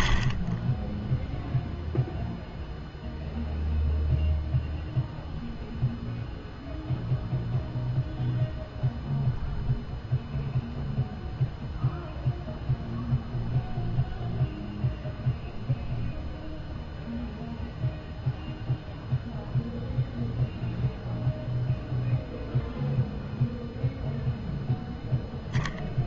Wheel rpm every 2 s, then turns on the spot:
10, 0, 0, 0, 0, 0, 0, 0, 0, 0, 0, 0, 0.
none